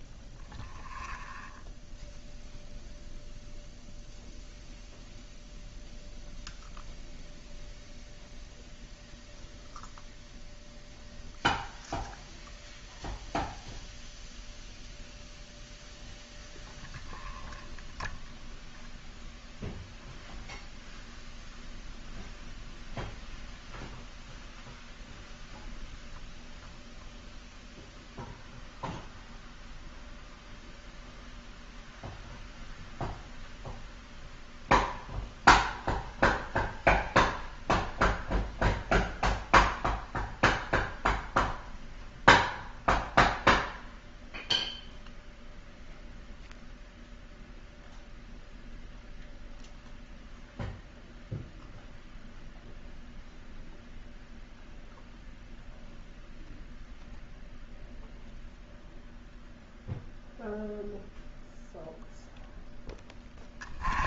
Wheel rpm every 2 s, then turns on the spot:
0, 0, 0, 0, 0, 0, 0, 0, 0, 0, 0, 0, 0, 0, 0, 0, 0, 0, 0, 0, 0, 0, 0, 0, 0, 0, 0, 0, 0, 0, 0, 10.
none